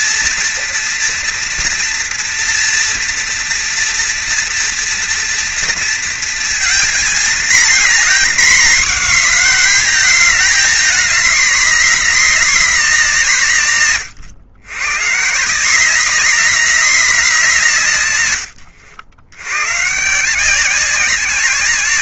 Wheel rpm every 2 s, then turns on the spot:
230, 230, 230, 230, 240, 220, 200, 130, 210, 80, 180.
none